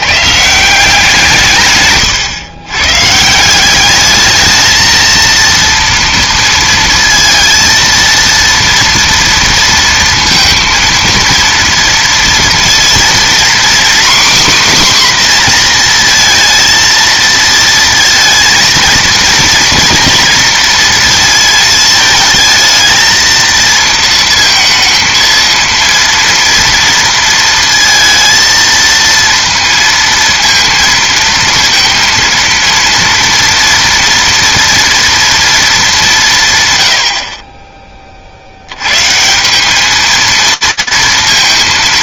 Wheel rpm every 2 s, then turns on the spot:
140, 130, 210, 230, 230, 230, 230, 270, 230, 230, 230, 220, 230, 230, 230, 230, 230, 230, 150, 50, 220.
none